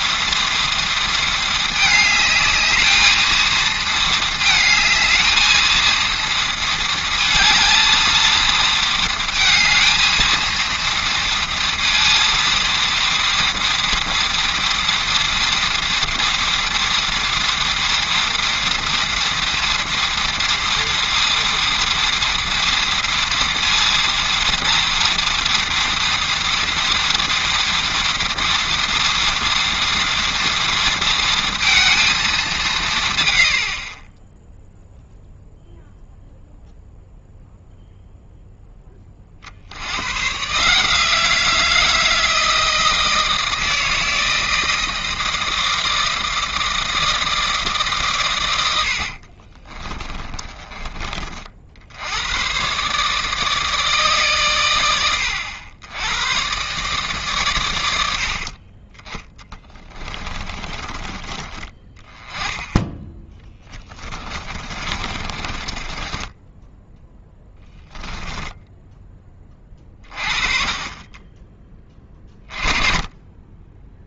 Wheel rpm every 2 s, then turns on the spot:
230, 220, 220, 230, 230, 230, 230, 230, 230, 230, 230, 230, 230, 230, 240, 230, 170, 0, 0, 20, 160, 160, 160, 160, 80, 30, 140, 100, 140, 30, 20, 10, 40, 10, 10, 40, 20.
48-50 60-62 64-66